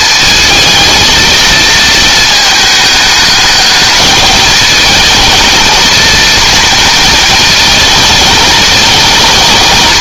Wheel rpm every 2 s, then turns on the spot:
230, 220, 230, 230, 220.
none